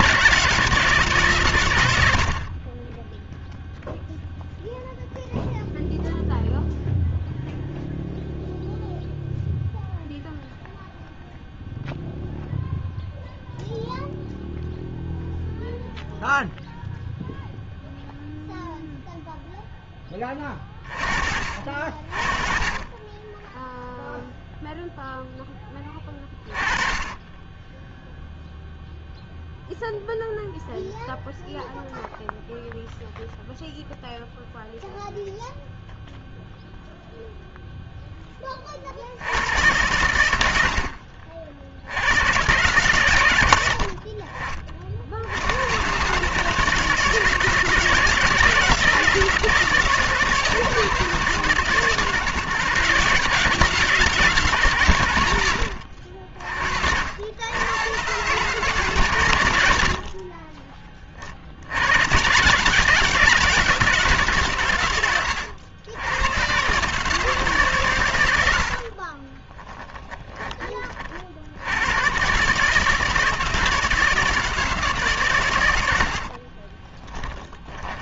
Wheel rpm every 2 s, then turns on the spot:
150, 20, 0, 0, 0, 0, 0, 0, 0, 0, 30, 30, 0, 20, 0, 0, 0, 0, 0, 20, 90, 120, 50, 150, 160, 160, 150, 150, 50, 140, 30, 130, 130, 120, 90, 20, 140, 160, 40.
60-62 76-78